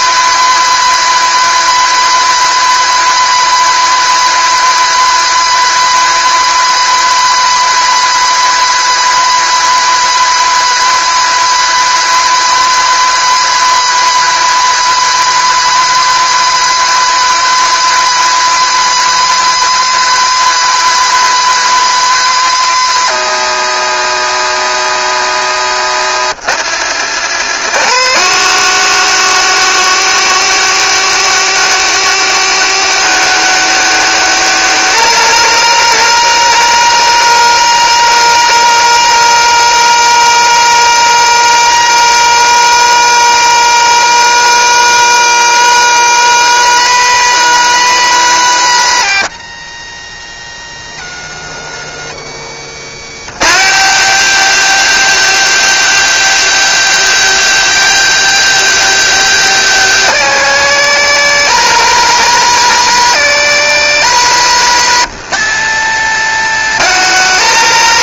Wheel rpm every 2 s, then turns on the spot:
230, 230, 230, 230, 230, 230, 230, 230, 230, 230, 230, 230, 220, 220, 220, 220, 220, 220, 220, 220, 220, 220, 230, 230, 230, 240, 210, 200, 200, 200, 220, 220, 210, 220.
none